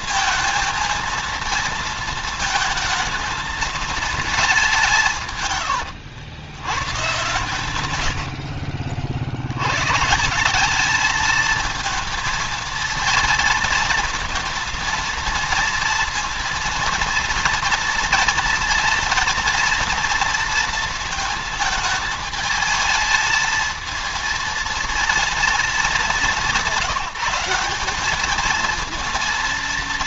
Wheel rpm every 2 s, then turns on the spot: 220, 220, 190, 100, 60, 190, 230, 230, 230, 230, 230, 220, 230, 180, 220.
none